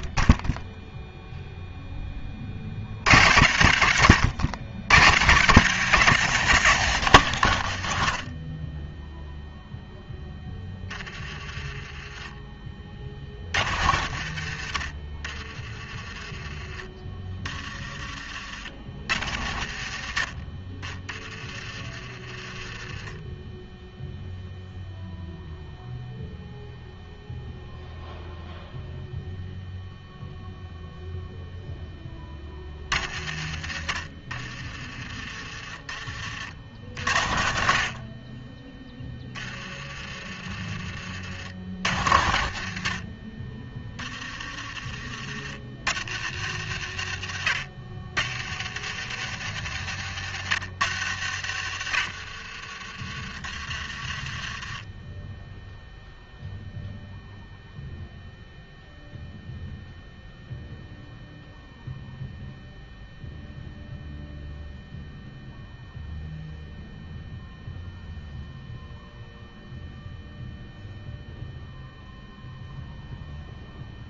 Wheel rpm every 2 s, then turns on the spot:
10, 60, 90, 160, 20, 10, 20, 70, 20, 60, 30, 20, 0, 0, 0, 0, 40, 30, 50, 10, 30, 60, 30, 80, 80, 80, 30, 10, 0, 0, 0, 0, 0, 0, 0, 0, 0.
none